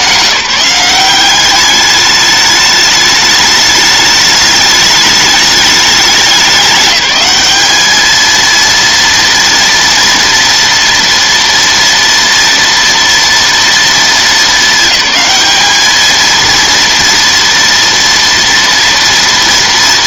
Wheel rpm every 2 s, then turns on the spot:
180, 210, 210, 200, 230, 230, 230, 210, 230, 230.
none